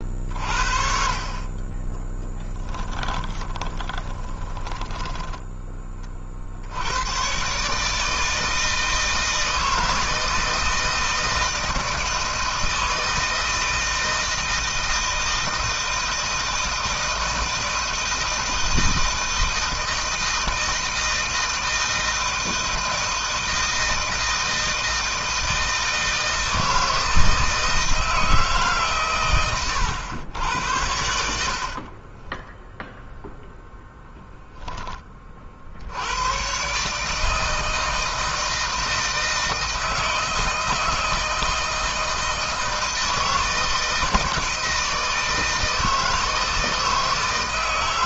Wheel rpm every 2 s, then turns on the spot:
50, 10, 20, 70, 160, 160, 160, 160, 160, 160, 160, 160, 160, 160, 150, 90, 10, 10, 130, 160, 160, 160, 160, 160.
2-6 32-34